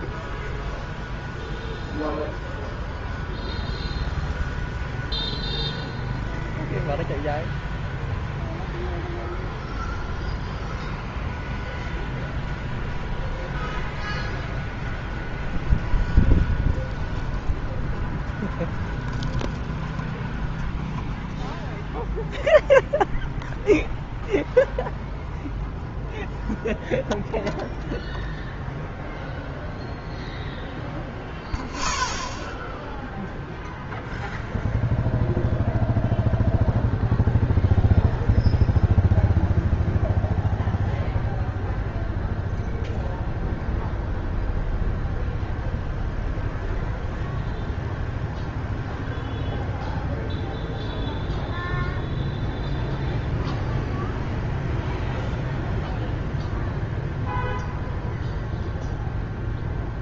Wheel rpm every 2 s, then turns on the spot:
0, 0, 0, 0, 0, 0, 0, 0, 0, 0, 0, 0, 0, 0, 0, 0, 0, 0, 0, 0, 0, 0, 0, 0, 0, 0, 0, 0, 0, 0.
none